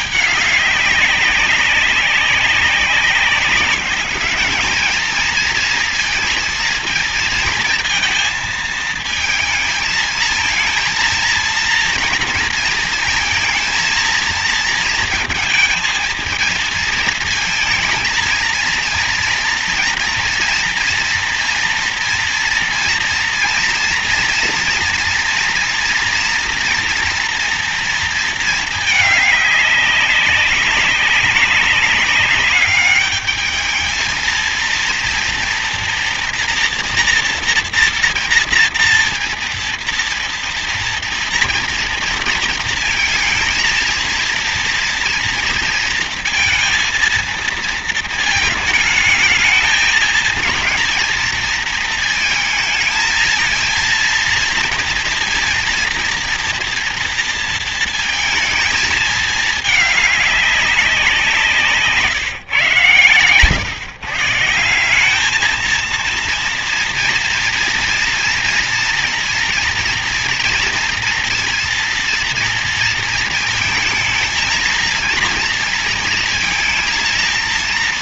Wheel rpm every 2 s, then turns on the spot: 210, 190, 210, 230, 220, 220, 230, 230, 230, 230, 230, 230, 230, 240, 220, 200, 200, 230, 230, 240, 230, 230, 230, 230, 220, 220, 230, 230, 230, 220, 200, 130, 160, 230, 230, 240, 230, 220, 230.
none